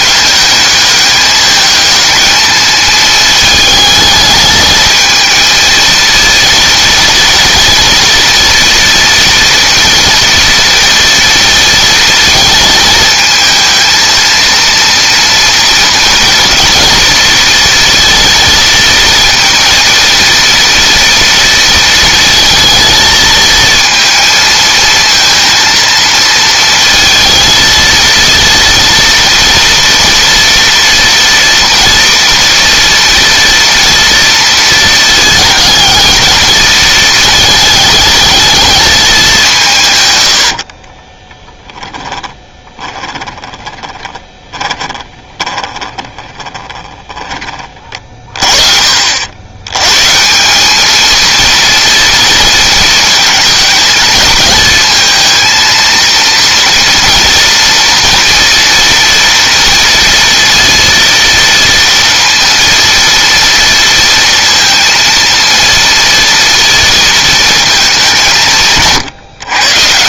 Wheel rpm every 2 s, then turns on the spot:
210, 220, 220, 230, 230, 230, 220, 230, 230, 230, 230, 230, 230, 230, 230, 230, 230, 230, 220, 220, 60, 20, 20, 10, 50, 200, 220, 220, 230, 230, 230, 230, 230, 230, 140.
40-48